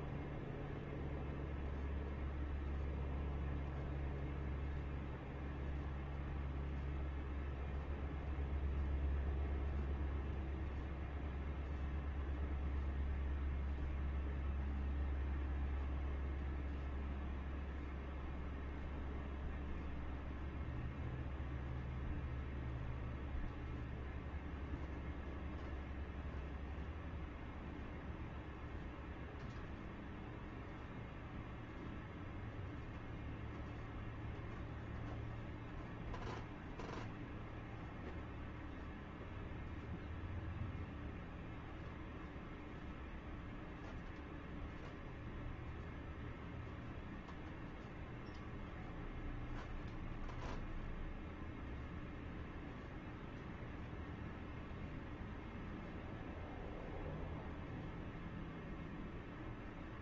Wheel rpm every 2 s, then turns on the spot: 0, 0, 0, 0, 0, 0, 0, 0, 0, 0, 0, 0, 0, 0, 0, 0, 0, 0, 0, 0, 0, 0, 0, 0, 0, 0, 0, 0, 0, 0.
none